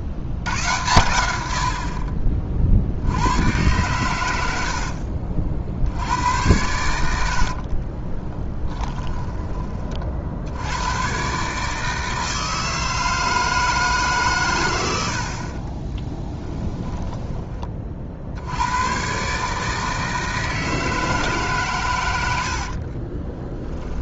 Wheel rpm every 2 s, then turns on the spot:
90, 50, 70, 90, 10, 100, 160, 100, 10, 100, 160, 50.
4-6 8-10 16-18 22-24